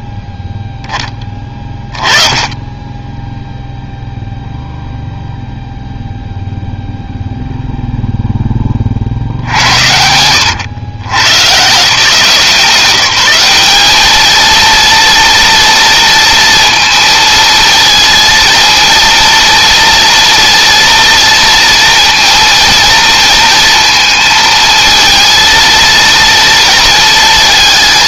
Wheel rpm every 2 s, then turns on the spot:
10, 10, 0, 0, 50, 110, 180, 230, 230, 230, 230, 230, 220, 230.
none